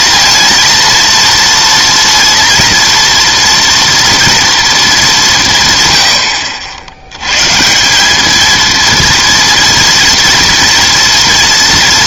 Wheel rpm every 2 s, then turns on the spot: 230, 230, 220, 70, 230, 240.
none